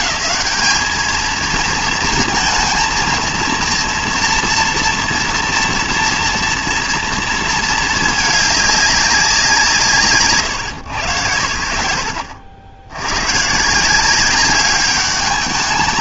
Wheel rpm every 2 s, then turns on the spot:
220, 230, 230, 230, 210, 110, 80, 200.
none